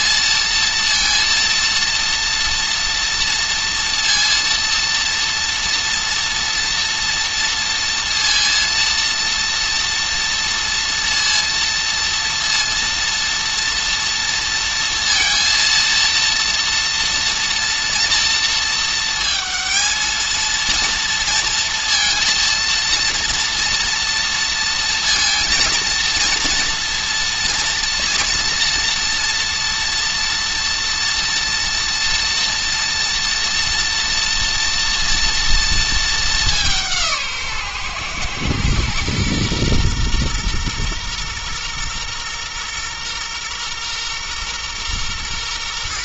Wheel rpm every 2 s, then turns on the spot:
230, 240, 230, 230, 230, 230, 240, 230, 230, 220, 230, 230, 230, 230, 230, 230, 230, 230, 180, 120, 120, 120, 120.
none